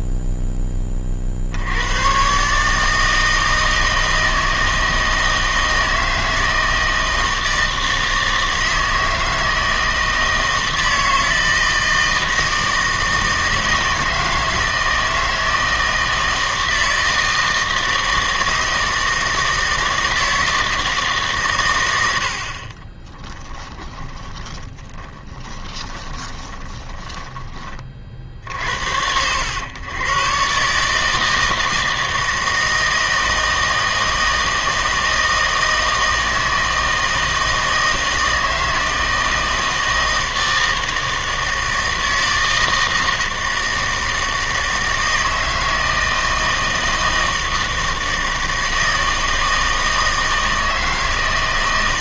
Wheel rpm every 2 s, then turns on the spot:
60, 160, 160, 160, 160, 160, 160, 160, 160, 160, 130, 10, 10, 20, 90, 160, 160, 160, 160, 160, 160, 160, 160, 160, 160, 160.
22-26